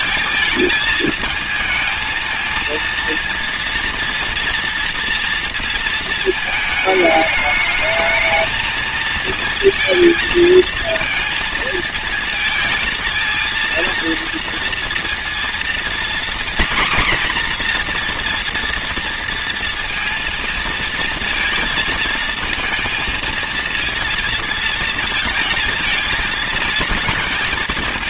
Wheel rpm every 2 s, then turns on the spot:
220, 230, 230, 220, 220, 220, 230, 230, 240, 240, 230, 220, 230, 220.
none